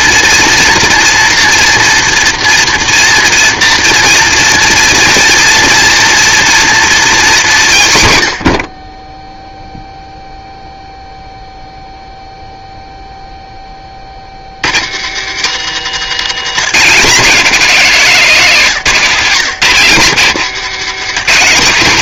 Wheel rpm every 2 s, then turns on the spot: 240, 230, 240, 240, 50, 0, 0, 70, 180, 170, 160.
none